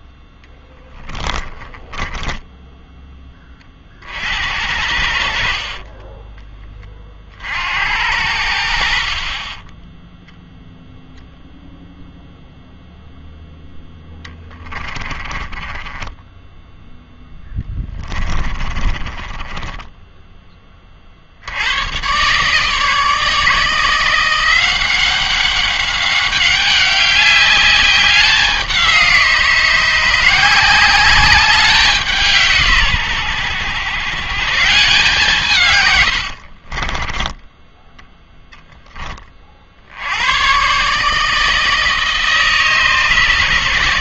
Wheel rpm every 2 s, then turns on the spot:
10, 10, 70, 30, 60, 0, 0, 20, 0, 20, 20, 150, 180, 190, 180, 180, 140, 150, 40, 10, 120, 150.
0-4 14-16 18-20 36-38